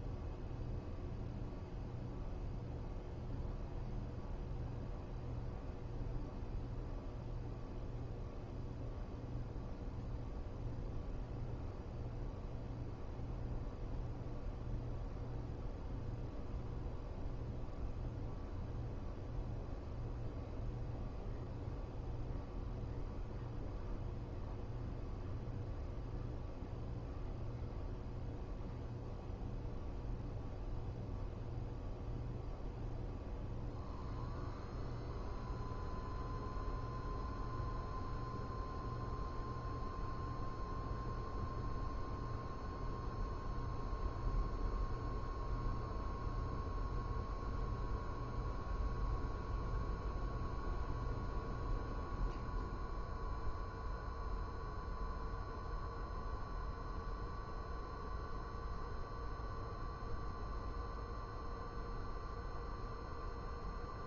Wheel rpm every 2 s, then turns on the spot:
0, 0, 0, 0, 0, 0, 0, 0, 0, 0, 0, 0, 0, 0, 0, 0, 0, 0, 0, 0, 0, 0, 0, 0, 0, 0, 0, 0, 0, 0, 0, 0.
none